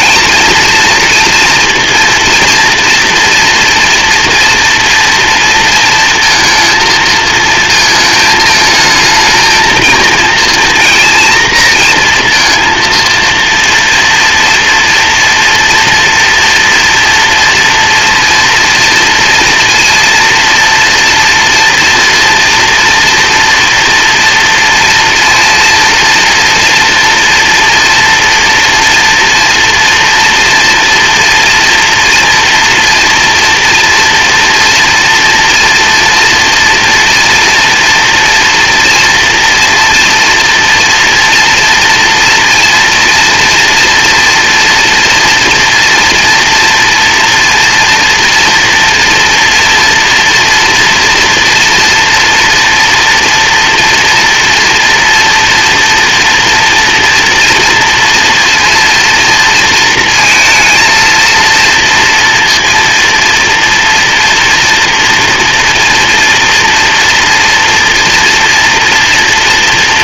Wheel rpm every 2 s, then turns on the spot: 230, 230, 230, 230, 220, 230, 230, 240, 240, 230, 230, 230, 230, 230, 230, 230, 230, 240, 230, 230, 230, 230, 230, 230, 230, 230, 230, 240, 230, 230, 230, 230, 230, 230, 230.
none